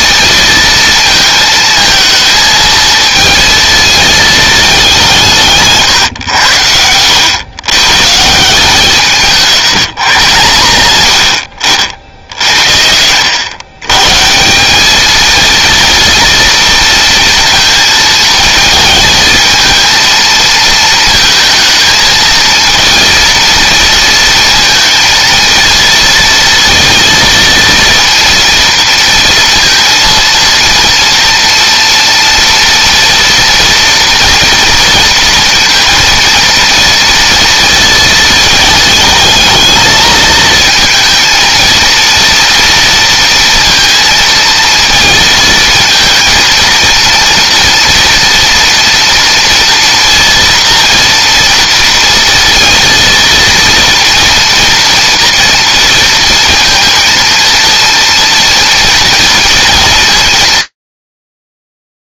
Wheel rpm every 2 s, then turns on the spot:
230, 220, 190, 90, 170, 110, 80, 200, 230, 220, 220, 230, 230, 230, 230, 230, 230, 230, 230, 220, 220, 230, 220, 230, 230, 240, 230, 230, 230, 230, 120.
none